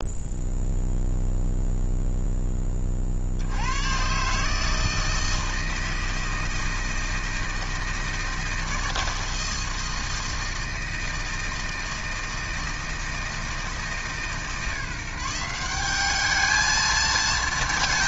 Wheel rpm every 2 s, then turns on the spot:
0, 20, 160, 160, 160, 160, 160, 160, 220.
none